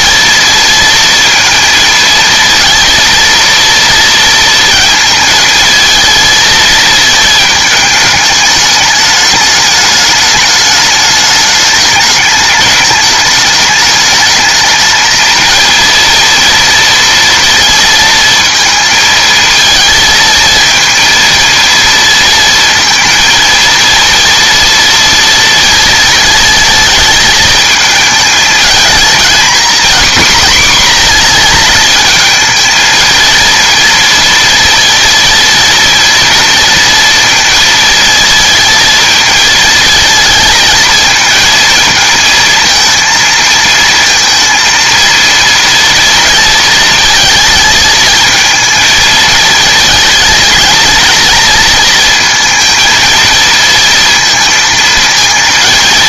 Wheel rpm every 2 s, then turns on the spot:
230, 230, 230, 220, 210, 210, 210, 220, 230, 230, 220, 230, 230, 220, 220, 240, 220, 230, 230, 230, 230, 220, 230, 230, 220, 230, 230, 230.
none